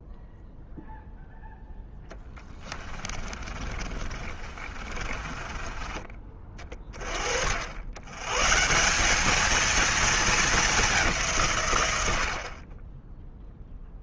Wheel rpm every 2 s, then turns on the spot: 0, 20, 40, 30, 160, 210, 40.
2-6